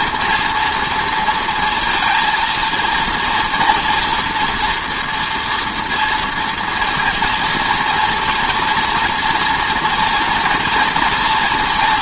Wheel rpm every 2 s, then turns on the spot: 230, 230, 240, 230, 240, 230.
none